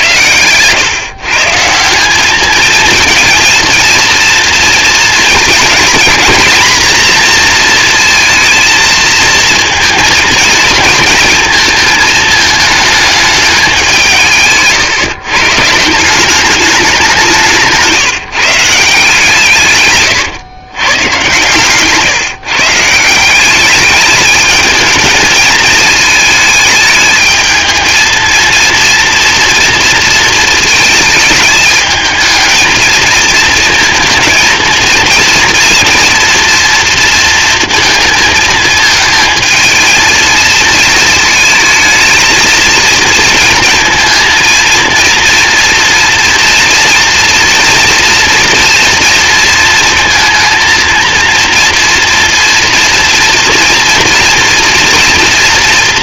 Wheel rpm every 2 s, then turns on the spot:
120, 220, 230, 230, 230, 230, 220, 150, 200, 170, 120, 150, 220, 220, 230, 220, 220, 230, 230, 220, 230, 230, 230, 240, 230, 230, 240, 230.
none